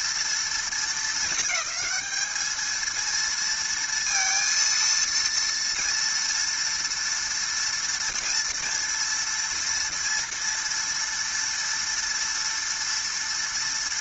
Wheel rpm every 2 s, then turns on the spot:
230, 220, 230, 230, 230, 230, 230.
none